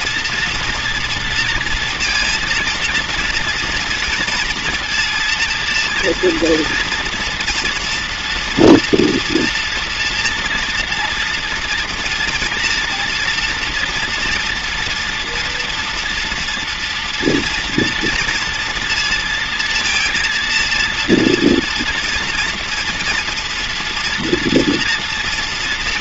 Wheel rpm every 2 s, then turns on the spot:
230, 230, 230, 230, 240, 240, 240, 240, 230, 230, 230, 230, 240.
none